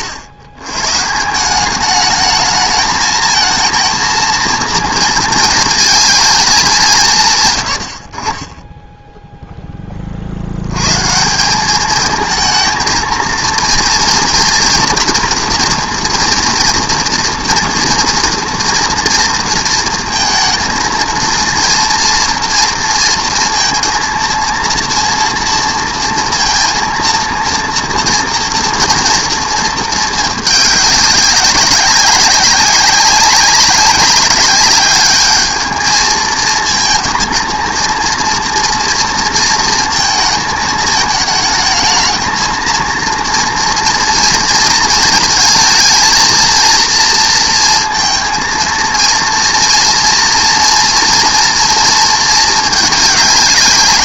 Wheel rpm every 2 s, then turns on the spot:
130, 220, 230, 190, 10, 120, 220, 240, 240, 230, 220, 230, 230, 230, 230, 200, 200, 200, 220, 230, 220, 230, 220, 230, 230, 230, 220.
none